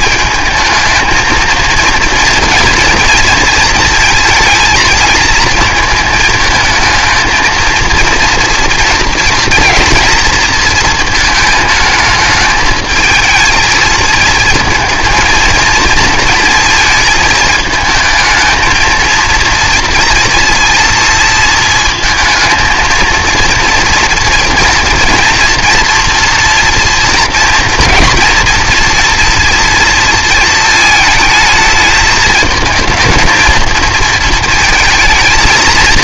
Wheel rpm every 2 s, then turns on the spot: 220, 230, 230, 220, 230, 230, 220, 230, 230, 220, 230, 230, 230, 230, 230, 220, 220, 230.
none